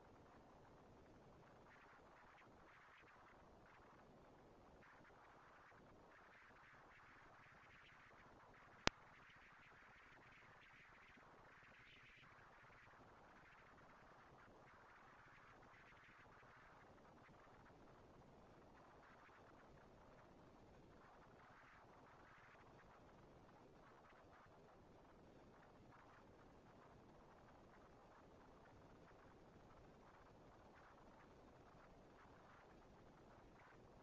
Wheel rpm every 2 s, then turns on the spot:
230, 210, 210, 230, 230, 230, 230, 230, 230, 230, 200, 140, 90, 180, 220, 230, 230.
none